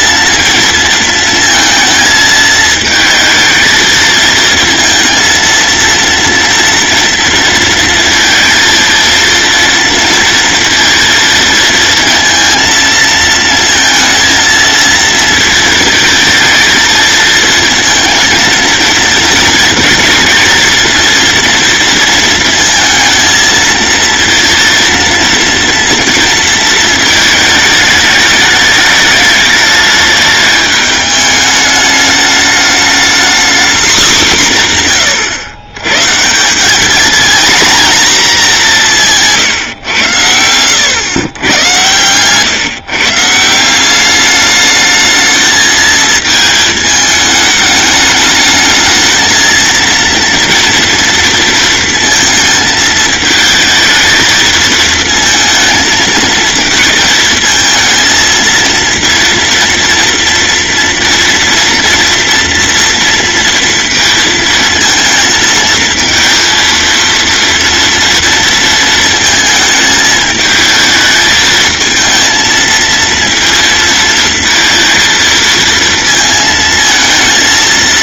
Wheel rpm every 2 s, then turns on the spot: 230, 220, 230, 240, 230, 230, 230, 230, 230, 230, 230, 220, 230, 220, 210, 210, 210, 170, 190, 200, 100, 130, 210, 220, 220, 230, 220, 220, 230, 230, 230, 230, 230, 230, 230, 220, 230, 230, 220.
none